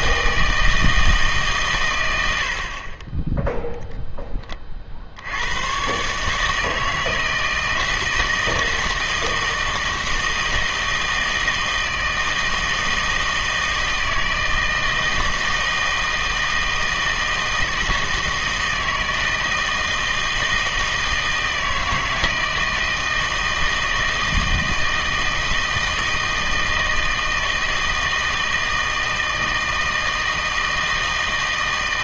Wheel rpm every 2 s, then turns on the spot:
160, 60, 30, 160, 160, 160, 160, 160, 160, 160, 160, 160, 160, 160, 160, 160.
none